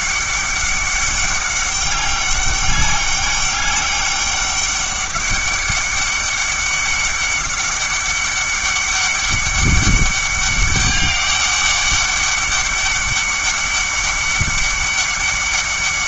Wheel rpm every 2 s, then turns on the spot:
200, 200, 200, 200, 190, 200, 200, 200.
none